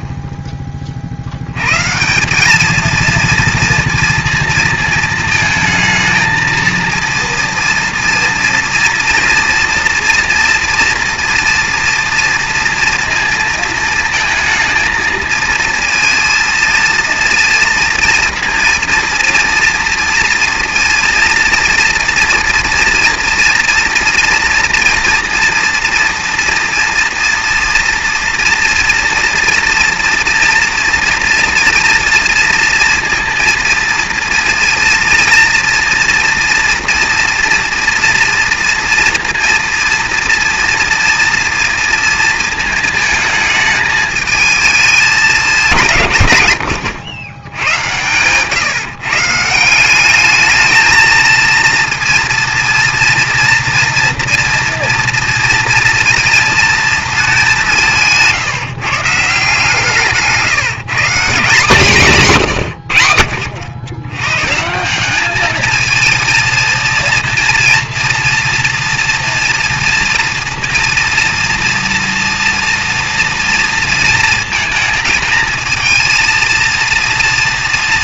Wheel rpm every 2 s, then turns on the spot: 20, 200, 230, 230, 230, 230, 230, 230, 230, 230, 230, 240, 230, 230, 230, 230, 230, 230, 230, 230, 230, 220, 220, 110, 130, 210, 230, 230, 230, 150, 160, 130, 150, 230, 230, 230, 230, 230, 220.
none